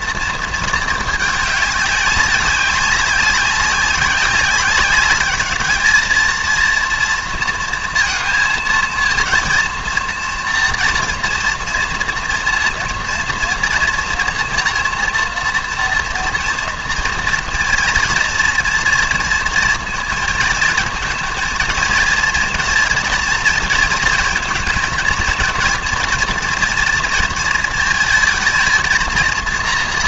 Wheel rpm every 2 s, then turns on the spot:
220, 200, 190, 230, 230, 230, 230, 240, 230, 230, 220, 230, 230, 240, 220.
none